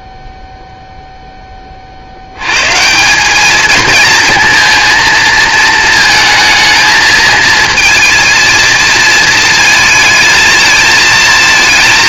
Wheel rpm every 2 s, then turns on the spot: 0, 120, 220, 220, 230, 220.
none